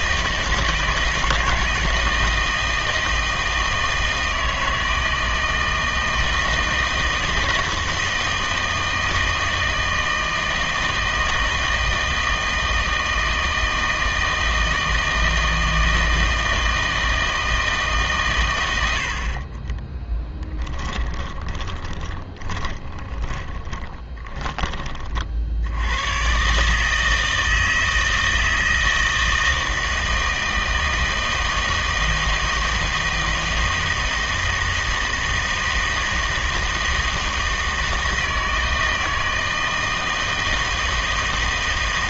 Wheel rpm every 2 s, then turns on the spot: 160, 160, 160, 160, 160, 160, 160, 160, 160, 110, 10, 20, 20, 140, 160, 160, 160, 160, 160, 160, 160.
20-24